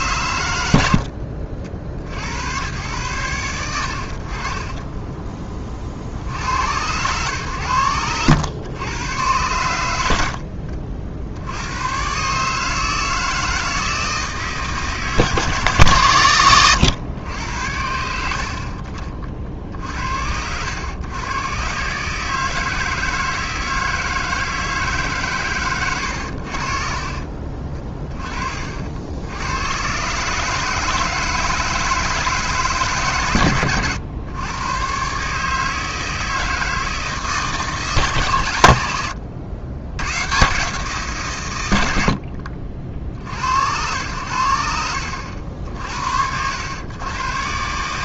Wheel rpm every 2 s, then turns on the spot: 90, 110, 20, 100, 110, 70, 160, 150, 100, 30, 100, 160, 140, 50, 70, 160, 140, 120, 160, 100, 140, 60, 80, 120.
4-6 26-28